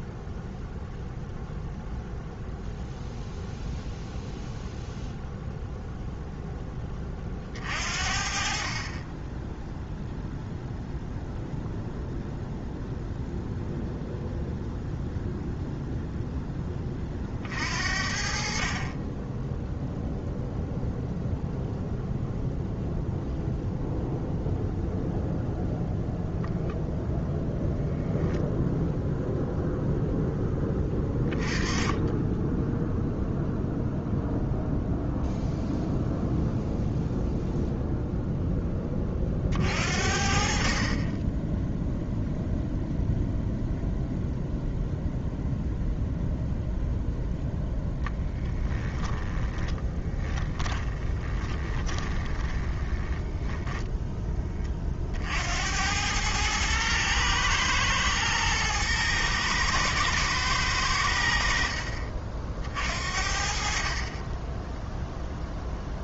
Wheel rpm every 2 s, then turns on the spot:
0, 0, 0, 10, 30, 0, 0, 0, 20, 50, 0, 0, 0, 0, 0, 10, 0, 0, 0, 20, 50, 0, 0, 0, 20, 20, 20, 30, 110, 110, 100, 50, 10.
48-54